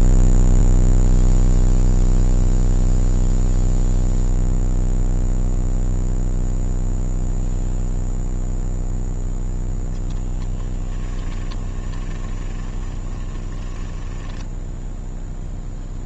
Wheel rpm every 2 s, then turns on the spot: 0, 0, 0, 0, 0, 10, 20, 10.
10-16